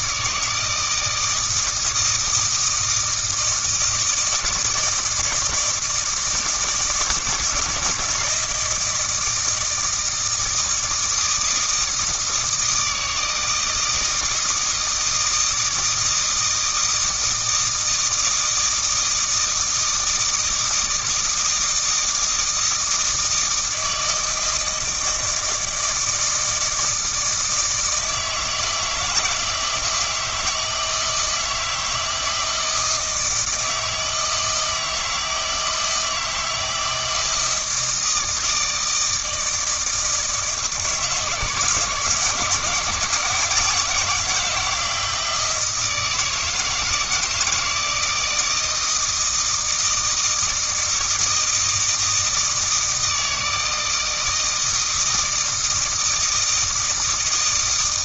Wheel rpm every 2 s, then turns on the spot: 160, 160, 160, 160, 160, 160, 160, 160, 160, 160, 160, 160, 160, 160, 160, 160, 160, 160, 160, 160, 160, 150, 170, 160, 160, 160, 160, 160, 160.
none